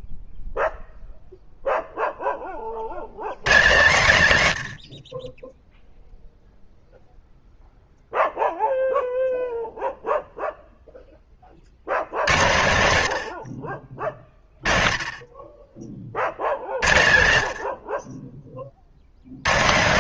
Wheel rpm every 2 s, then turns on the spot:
0, 90, 80, 0, 0, 0, 130, 30, 70, 60.
none